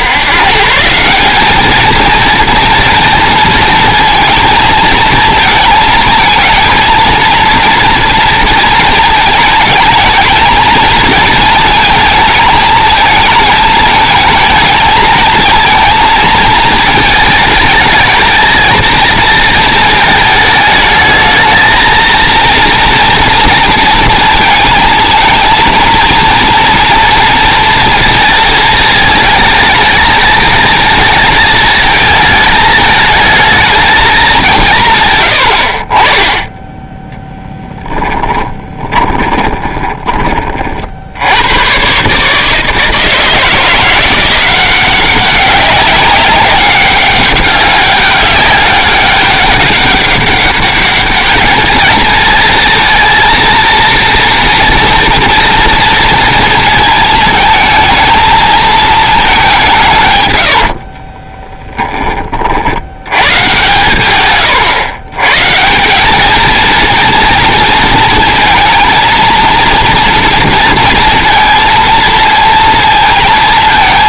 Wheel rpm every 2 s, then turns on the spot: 160, 230, 230, 230, 220, 220, 220, 220, 220, 230, 220, 230, 220, 230, 220, 220, 220, 140, 10, 20, 50, 160, 180, 200, 200, 200, 230, 230, 230, 220, 60, 80, 120, 230, 230, 230, 230.
38-40 60-62